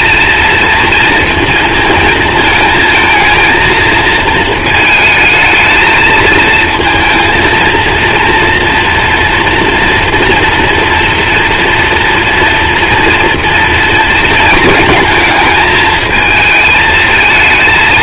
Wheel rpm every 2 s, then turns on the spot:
230, 220, 220, 230, 230, 230, 230, 220, 220.
none